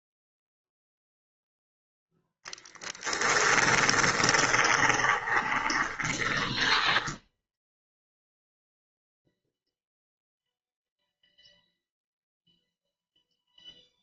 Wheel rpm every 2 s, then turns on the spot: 0, 10, 20, 10, 0, 0, 0.
2-8